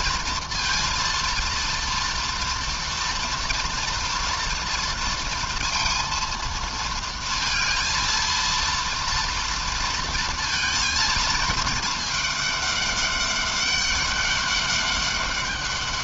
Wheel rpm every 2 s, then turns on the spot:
230, 230, 230, 230, 230, 220, 210, 200.
none